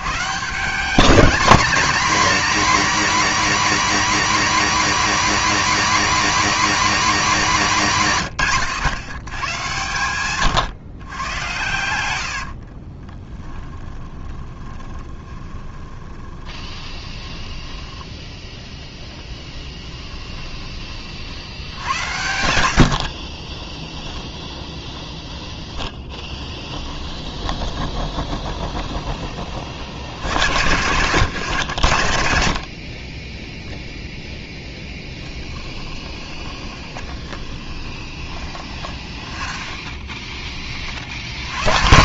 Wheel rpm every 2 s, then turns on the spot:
190, 280, 280, 280, 120, 120, 40, 20, 30, 10, 30, 70, 0, 10, 20, 120, 40, 10, 20, 10, 40.
12-18 22-24 26-30 34-40